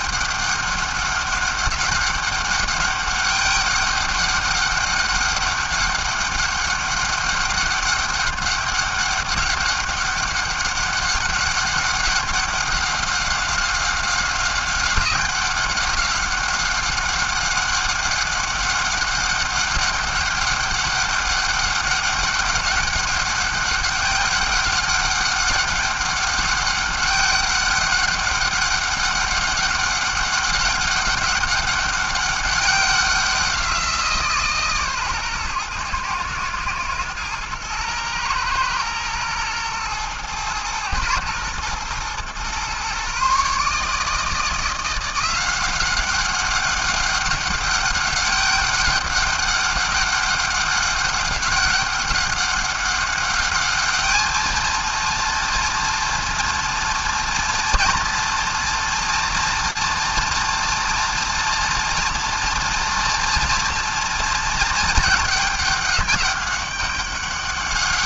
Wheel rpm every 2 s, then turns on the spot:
200, 200, 200, 200, 200, 200, 200, 190, 190, 190, 200, 200, 200, 200, 200, 200, 200, 170, 120, 120, 110, 120, 150, 190, 200, 200, 200, 210, 230, 230, 230, 230, 230, 200.
none